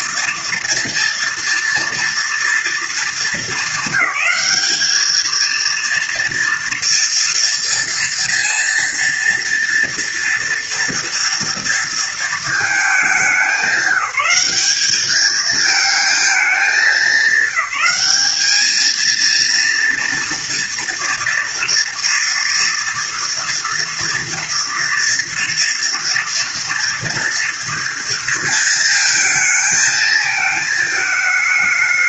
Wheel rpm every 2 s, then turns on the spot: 230, 230, 210, 240, 230, 230, 220, 200, 210, 210, 240, 230, 230, 230, 220, 220.
none